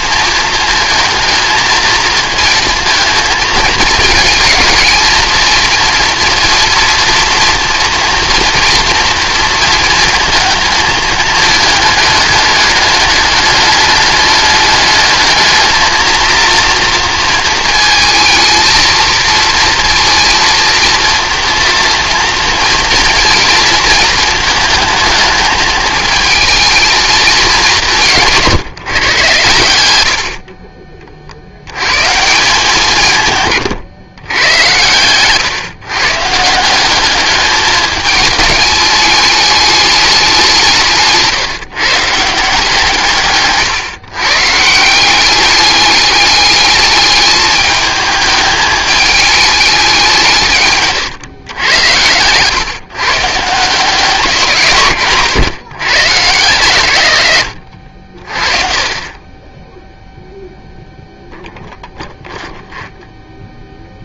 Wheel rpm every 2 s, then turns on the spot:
220, 230, 220, 240, 230, 220, 210, 210, 230, 220, 230, 230, 230, 220, 140, 40, 170, 110, 190, 210, 160, 150, 170, 210, 210, 130, 140, 140, 120, 30, 0, 0.
50-52